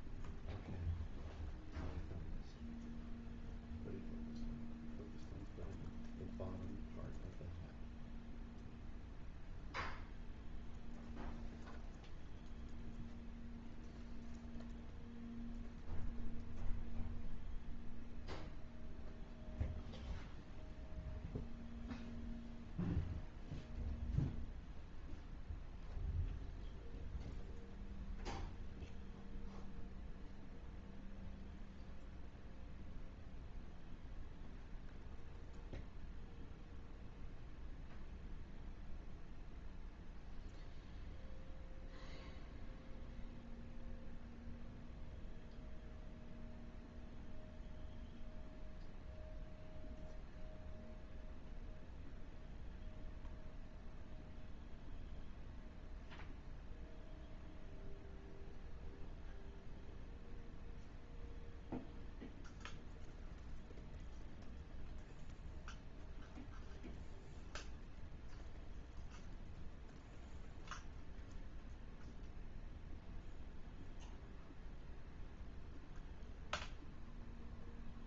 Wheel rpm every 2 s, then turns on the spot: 0, 0, 0, 0, 0, 0, 0, 0, 0, 0, 0, 0, 0, 0, 0, 0, 0, 0, 0, 0, 0, 0, 0, 0, 0, 0, 0, 0, 0, 0, 0, 0, 0, 0, 0, 0, 0, 0, 0.
none